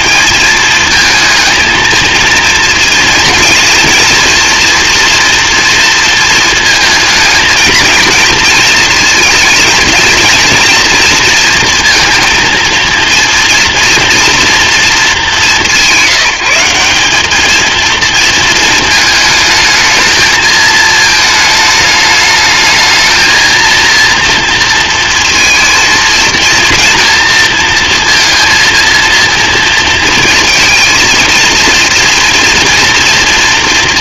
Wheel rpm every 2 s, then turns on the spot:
220, 230, 230, 220, 230, 230, 230, 210, 190, 220, 220, 220, 230, 230, 230, 220, 240.
none